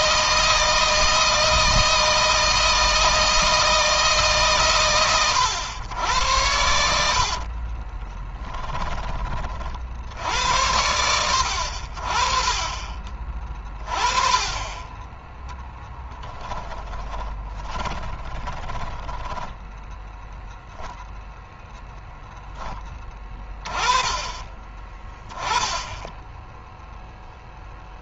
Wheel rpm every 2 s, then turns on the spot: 160, 160, 130, 80, 20, 80, 30, 20, 10, 20, 0, 10, 20, 0.
16-20